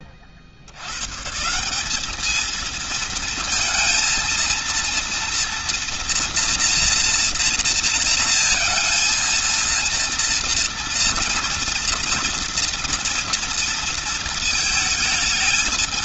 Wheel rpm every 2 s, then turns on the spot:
70, 220, 230, 240, 230, 230, 240, 220.
none